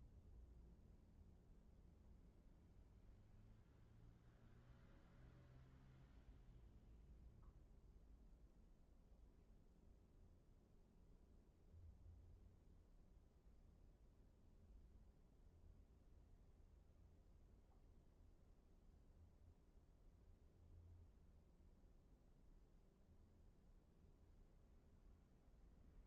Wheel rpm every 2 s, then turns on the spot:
0, 0, 0, 0, 0, 0, 0, 0, 0, 0, 0, 0, 0.
none